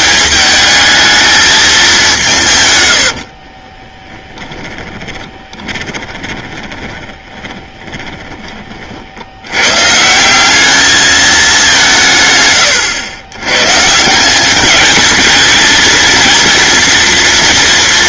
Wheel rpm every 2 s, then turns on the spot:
210, 100, 20, 20, 40, 210, 120, 210, 230.
2-8